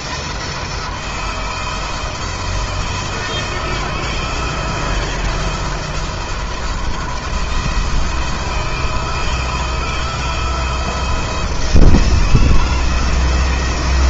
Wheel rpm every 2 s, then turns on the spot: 170, 160, 170, 160, 160, 170, 160.
none